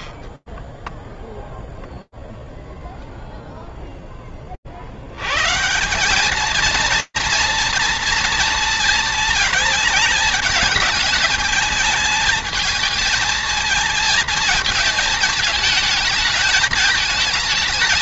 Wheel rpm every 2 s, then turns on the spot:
0, 0, 50, 230, 230, 210, 220, 230, 220.
none